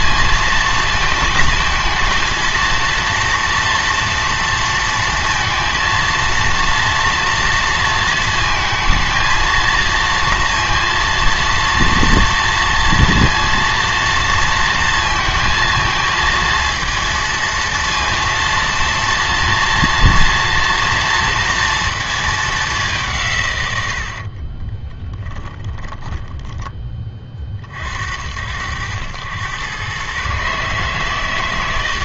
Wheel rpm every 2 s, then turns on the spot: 230, 230, 230, 230, 220, 230, 230, 230, 230, 230, 230, 200, 20, 10, 80, 140.
24-26